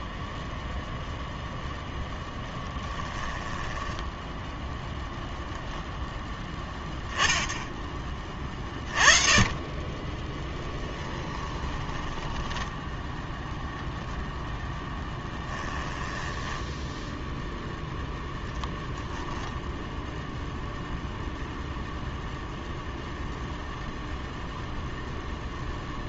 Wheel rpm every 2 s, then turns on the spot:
0, 10, 0, 10, 30, 10, 10, 10, 10, 0, 0, 0, 0.
2-4 10-14 16-18